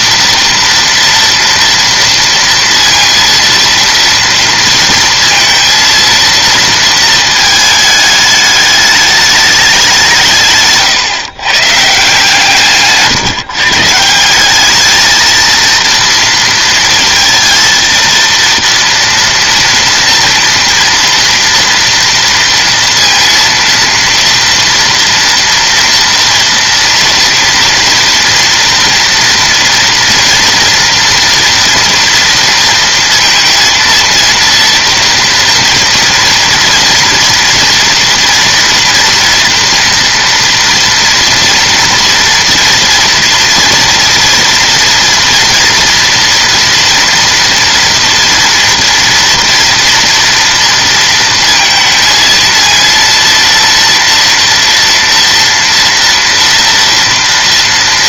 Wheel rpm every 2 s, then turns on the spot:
230, 230, 230, 230, 210, 140, 150, 210, 230, 230, 230, 230, 230, 230, 230, 230, 230, 230, 230, 230, 230, 230, 230, 230, 230, 230, 230, 230, 230.
none